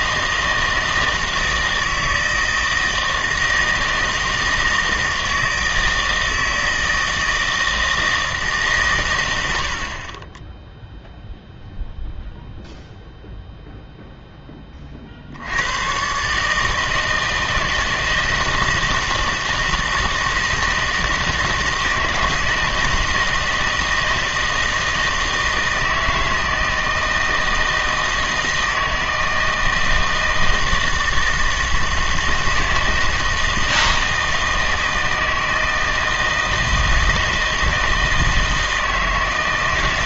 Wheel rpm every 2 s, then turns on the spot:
160, 160, 160, 160, 140, 0, 0, 20, 150, 160, 160, 160, 160, 160, 160, 160, 160, 160, 160, 160.
none